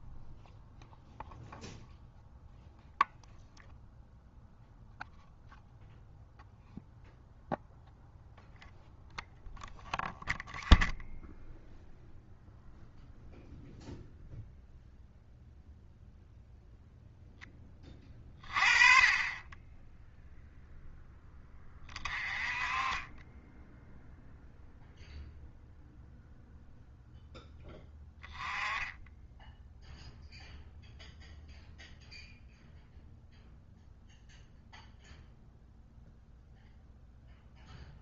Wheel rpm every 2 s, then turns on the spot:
0, 0, 0, 0, 0, 0, 0, 0, 0, 30, 0, 30, 0, 0, 10, 0, 0, 0, 0.
none